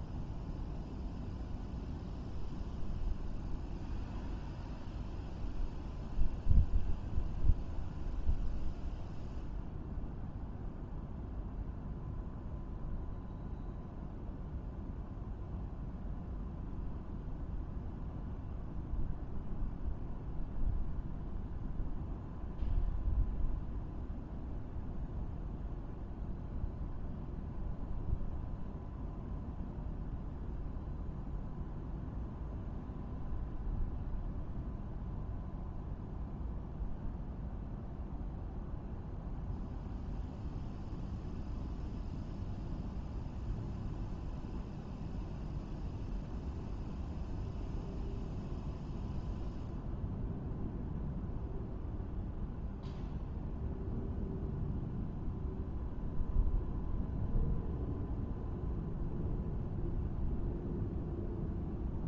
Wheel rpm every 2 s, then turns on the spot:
0, 0, 0, 0, 0, 0, 0, 0, 0, 0, 0, 0, 0, 0, 0, 0, 0, 0, 0, 0, 0, 0, 0, 0, 0, 0, 0, 0, 0, 0, 0.
none